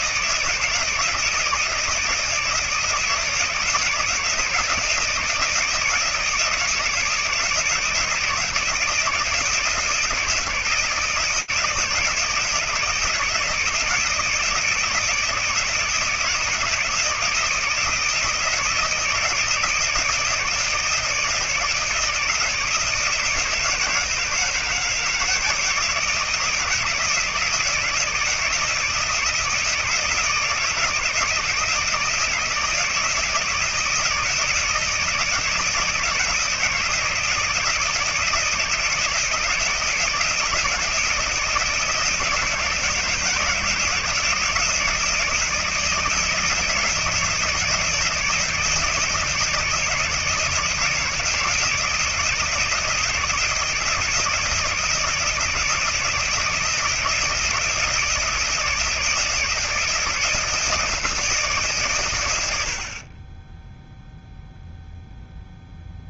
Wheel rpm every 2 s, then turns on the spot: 160, 160, 160, 160, 160, 170, 160, 160, 160, 160, 160, 160, 160, 160, 160, 160, 160, 170, 160, 160, 160, 160, 170, 170, 160, 160, 160, 170, 160, 160, 170, 110, 0.
none